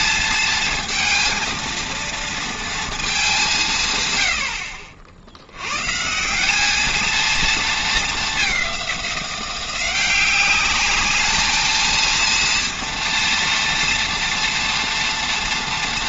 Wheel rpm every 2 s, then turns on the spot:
230, 230, 60, 210, 190, 200, 230, 230.
none